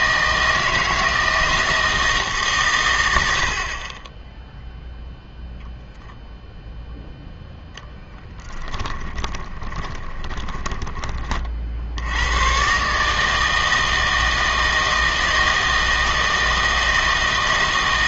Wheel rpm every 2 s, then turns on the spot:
160, 120, 0, 0, 10, 20, 130, 160, 160.
8-12